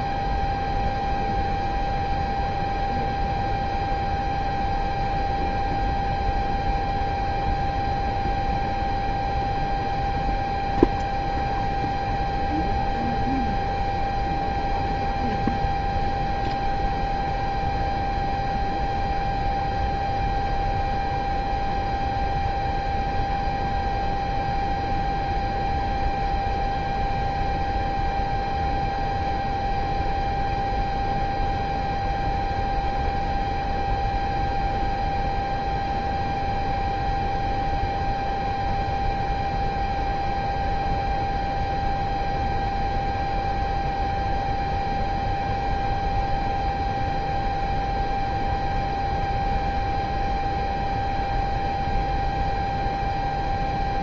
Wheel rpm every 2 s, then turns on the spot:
0, 0, 0, 0, 0, 0, 0, 0, 0, 0, 0, 0, 0, 0, 0, 0, 0, 0, 0, 0, 0, 0, 0, 0, 0, 0, 0.
none